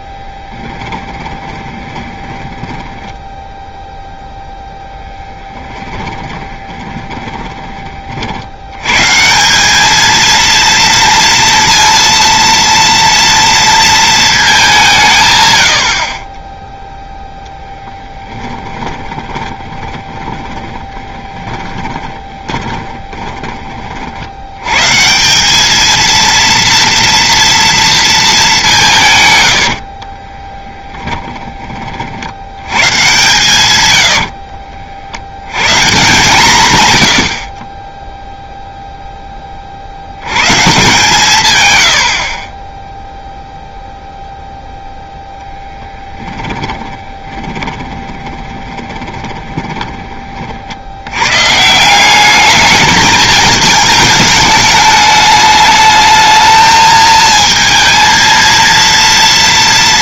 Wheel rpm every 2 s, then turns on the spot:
10, 10, 0, 20, 90, 230, 230, 190, 10, 20, 20, 20, 110, 230, 200, 10, 100, 50, 130, 0, 140, 20, 0, 10, 20, 70, 210, 210, 220, 230.
0-4 6-8 18-24 30-32 34-36 46-50